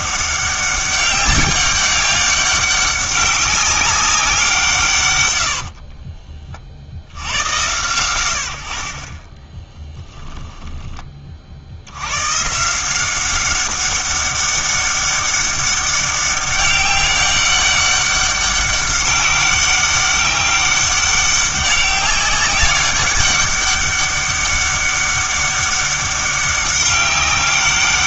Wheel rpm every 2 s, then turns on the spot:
200, 190, 160, 60, 50, 10, 160, 200, 200, 200, 200, 200, 200, 190.
none